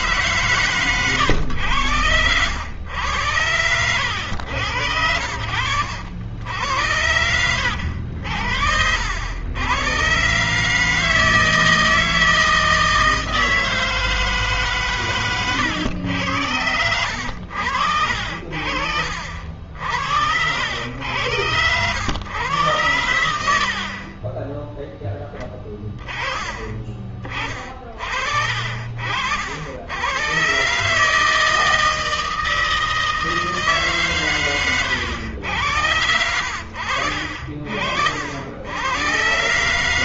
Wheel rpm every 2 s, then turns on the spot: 140, 100, 100, 80, 80, 130, 160, 140, 90, 70, 80, 110, 10, 20, 40, 120, 160, 120, 80, 70.
none